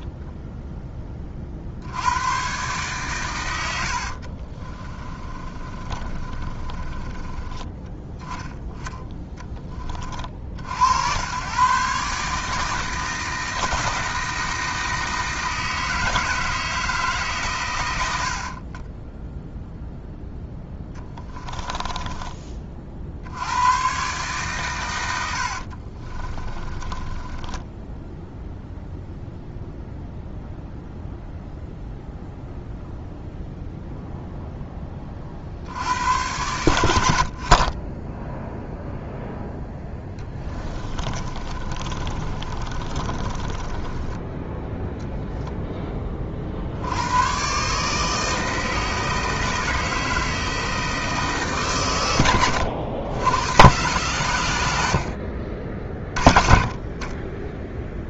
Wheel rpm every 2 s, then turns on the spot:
10, 130, 30, 20, 10, 80, 160, 160, 160, 30, 10, 40, 120, 20, 0, 0, 0, 20, 90, 0, 20, 30, 0, 70, 160, 160, 90, 90, 30.
4-8 20-22 26-28 40-44